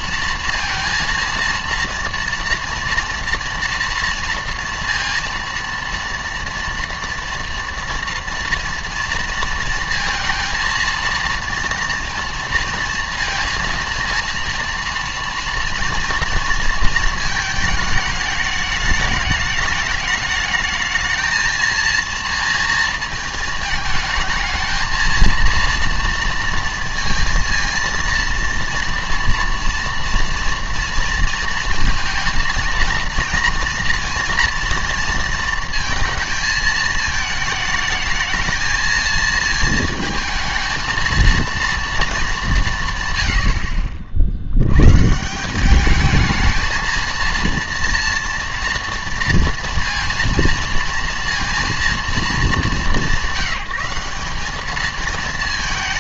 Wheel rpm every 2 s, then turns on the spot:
230, 230, 230, 230, 230, 230, 230, 230, 230, 210, 220, 230, 220, 230, 230, 240, 230, 230, 220, 220, 220, 180, 90, 220, 230, 230, 210, 210.
none